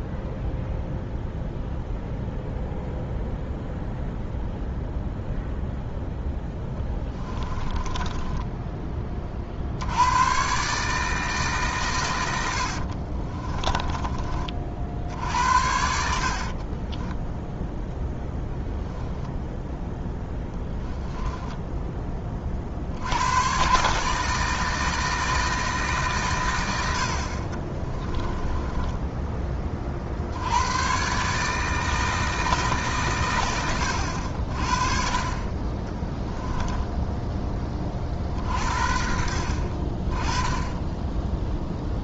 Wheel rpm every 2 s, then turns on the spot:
0, 0, 0, 10, 20, 150, 50, 60, 40, 0, 10, 70, 160, 70, 10, 110, 140, 50, 10, 60, 10.
6-8 12-14 16-18 20-22 28-30 36-38